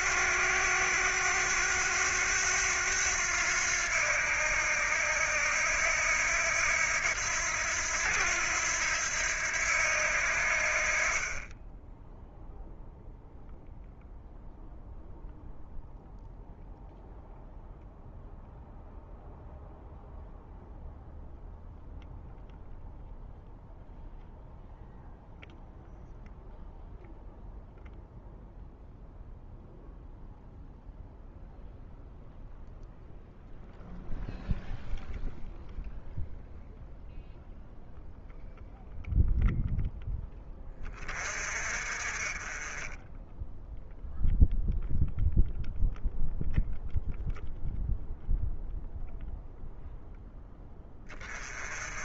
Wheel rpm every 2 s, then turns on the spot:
90, 90, 80, 90, 80, 40, 0, 0, 0, 0, 0, 0, 0, 0, 0, 0, 0, 0, 0, 0, 40, 10, 0, 0, 0, 20.
50-52